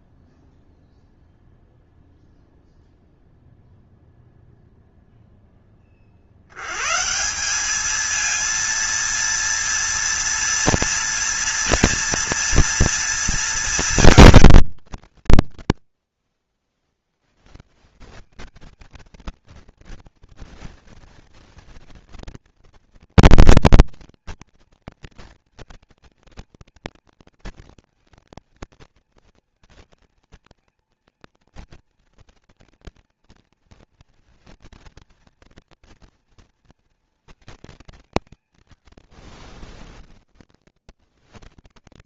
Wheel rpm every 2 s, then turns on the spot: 0, 0, 0, 140, 230, 230, 230, 180, 90, 220, 230, 230, 230, 230, 230, 230, 230, 230, 220, 90, 60.
38-40